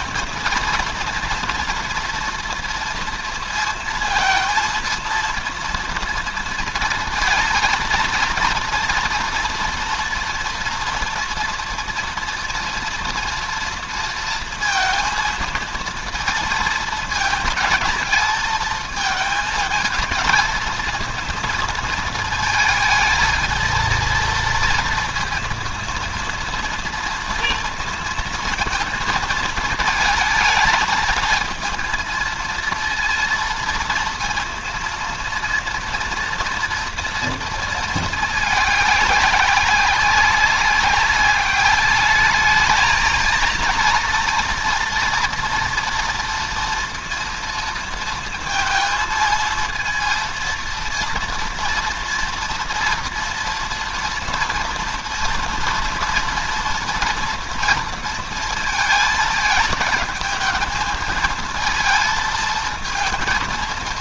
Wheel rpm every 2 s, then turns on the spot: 230, 230, 230, 230, 230, 240, 230, 230, 230, 220, 220, 220, 230, 230, 220, 220, 230, 230, 230, 210, 190, 220, 230, 230, 230, 230, 230, 230, 230, 230, 220, 220.
none